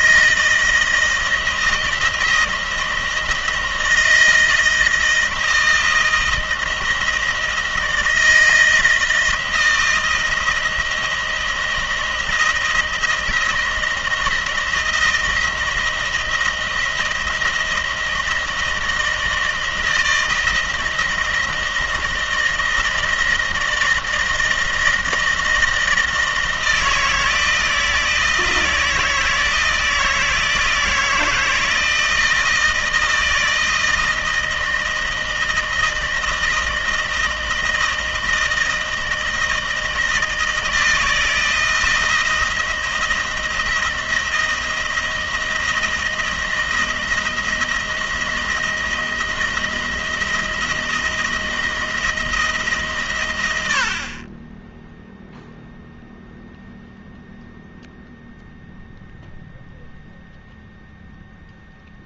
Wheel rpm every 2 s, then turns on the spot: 160, 170, 160, 160, 160, 170, 160, 170, 170, 160, 160, 160, 160, 160, 160, 160, 160, 160, 160, 160, 160, 160, 160, 160, 170, 160, 150, 10, 0, 0, 0.
none